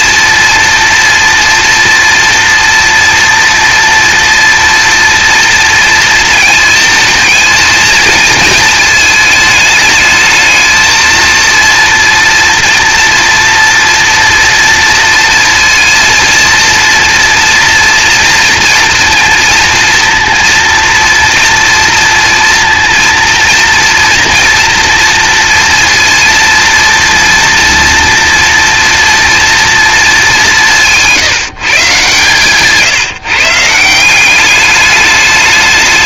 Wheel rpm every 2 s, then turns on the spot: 230, 230, 240, 220, 220, 220, 240, 230, 230, 230, 230, 230, 240, 230, 230, 190, 140, 200.
none